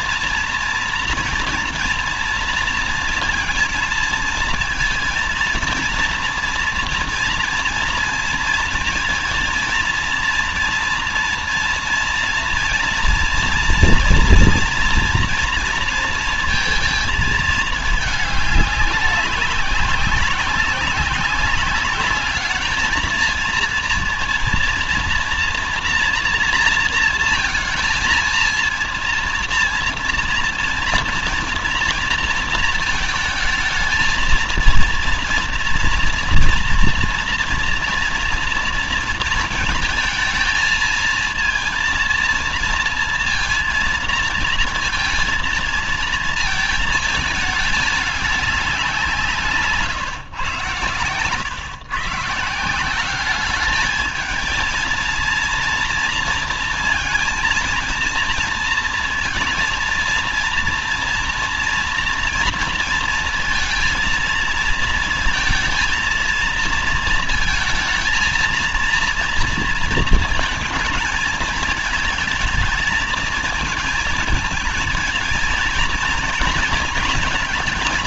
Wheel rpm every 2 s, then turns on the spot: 240, 230, 230, 230, 230, 230, 230, 230, 230, 200, 200, 210, 230, 230, 230, 230, 230, 230, 230, 230, 230, 230, 230, 230, 190, 120, 160, 220, 230, 230, 230, 240, 230, 220, 230, 220, 220, 220, 220.
none